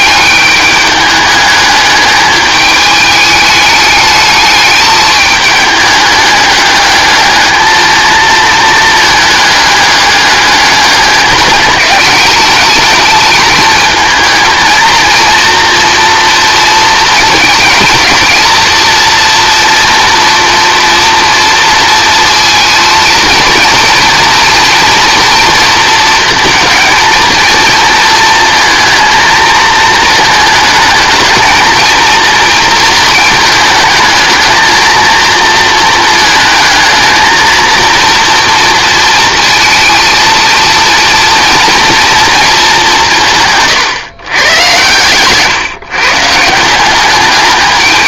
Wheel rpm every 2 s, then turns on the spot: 210, 210, 210, 210, 220, 200, 210, 230, 220, 230, 230, 230, 230, 230, 230, 220, 230, 230, 220, 230, 230, 190, 120, 180.
44-46